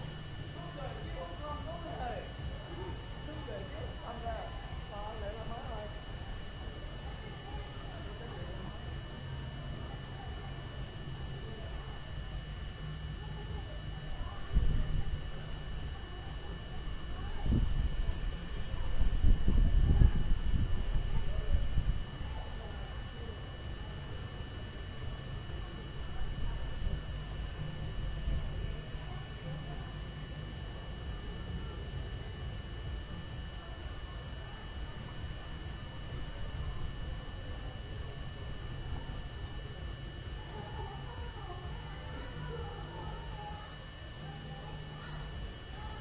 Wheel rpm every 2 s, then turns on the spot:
0, 0, 0, 0, 0, 0, 0, 0, 0, 0, 0, 0, 0, 0, 0, 0, 0, 0, 0, 0, 0, 0, 0.
none